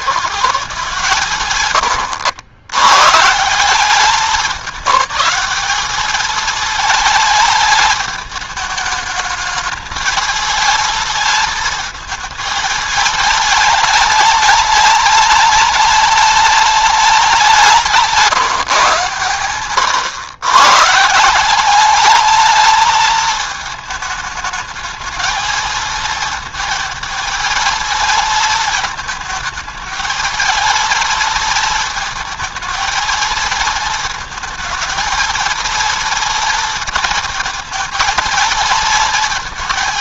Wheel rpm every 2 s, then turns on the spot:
150, 100, 200, 220, 210, 220, 220, 210, 210, 130, 150, 220, 220, 220, 220, 230, 220, 220, 230, 220.
none